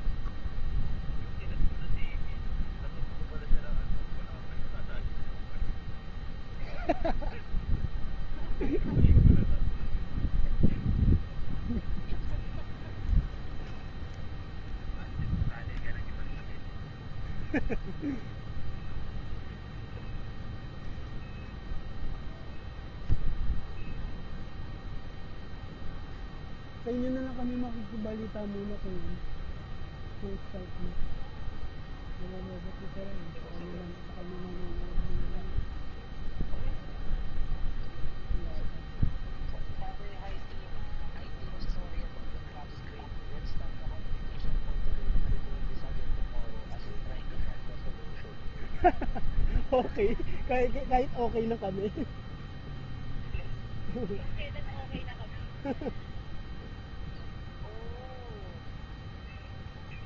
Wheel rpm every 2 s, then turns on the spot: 0, 0, 0, 0, 0, 0, 0, 0, 0, 0, 0, 0, 0, 0, 0, 0, 0, 0, 0, 0, 0, 0, 0, 0, 0, 0, 0, 0, 0, 0.
none